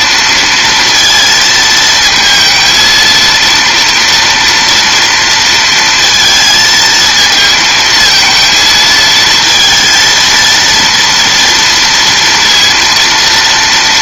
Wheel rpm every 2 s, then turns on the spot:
230, 230, 230, 220, 220, 230, 230.
none